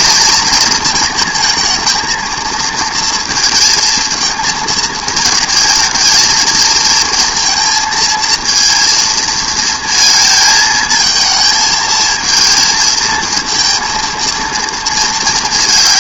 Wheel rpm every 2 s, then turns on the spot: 220, 230, 220, 220, 230, 220, 220, 230.
none